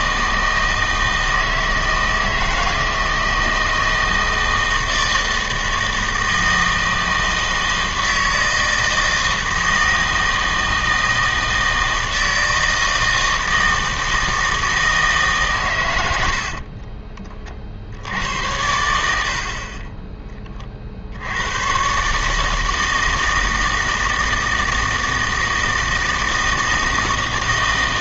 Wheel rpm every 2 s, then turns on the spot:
160, 160, 160, 160, 160, 160, 160, 160, 40, 90, 40, 160, 160, 160.
16-20